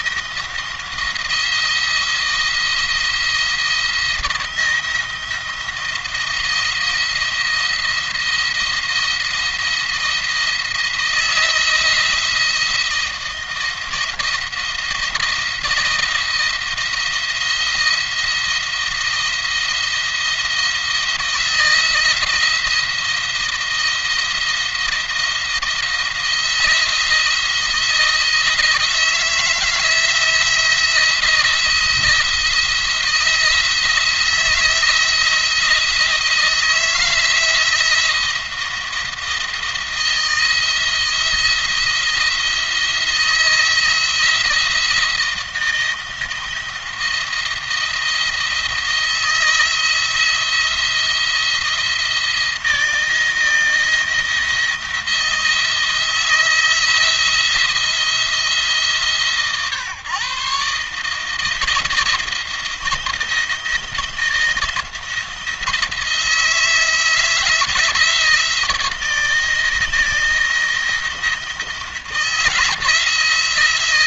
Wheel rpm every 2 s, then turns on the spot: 170, 170, 170, 170, 170, 170, 170, 170, 170, 170, 170, 170, 170, 170, 160, 170, 170, 160, 160, 170, 170, 160, 170, 170, 170, 170, 170, 170, 170, 160, 140, 160, 170, 160, 160, 170, 160.
none